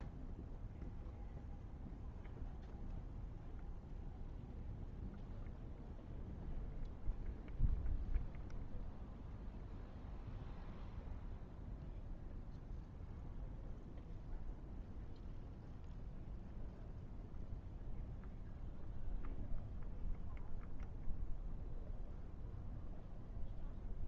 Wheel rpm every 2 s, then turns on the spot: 0, 0, 0, 0, 0, 0, 0, 0, 0, 0, 0, 0.
none